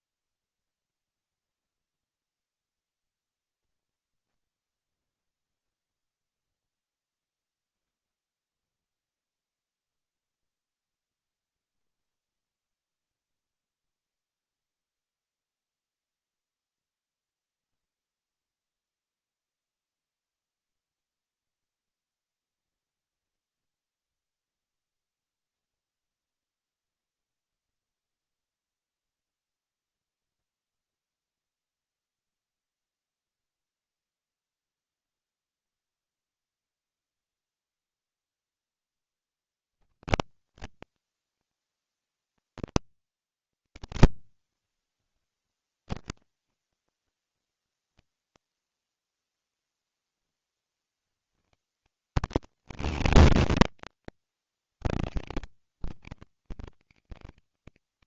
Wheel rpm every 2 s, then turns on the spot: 0, 0, 0, 0, 0, 0, 0, 0, 0, 0, 0, 0, 0, 0, 0, 0, 0, 0, 0, 0, 150, 140, 100, 190, 160, 40, 170, 100, 150.
none